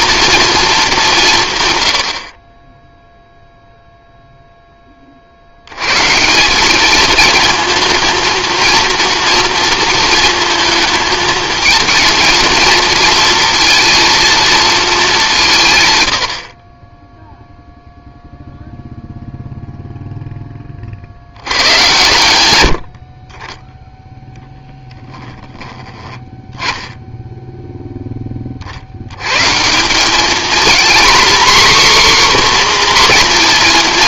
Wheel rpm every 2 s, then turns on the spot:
210, 10, 10, 200, 230, 230, 230, 220, 30, 0, 20, 60, 10, 10, 60, 230, 260.
24-26